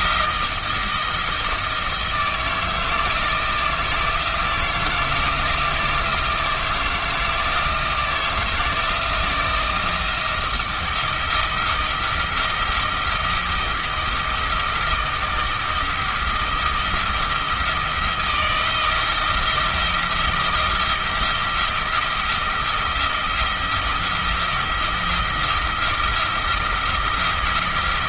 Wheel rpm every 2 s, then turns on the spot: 170, 160, 160, 160, 170, 170, 170, 170, 170, 170, 170, 170, 170, 170.
none